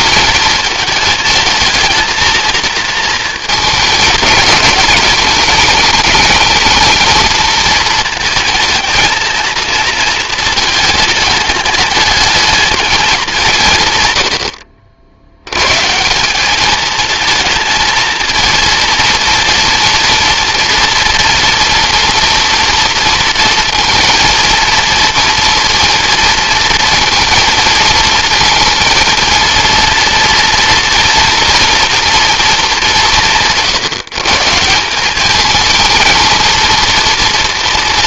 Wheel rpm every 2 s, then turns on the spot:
220, 230, 210, 220, 230, 220, 220, 70, 210, 230, 240, 240, 230, 230, 230, 230, 210, 180, 230.
none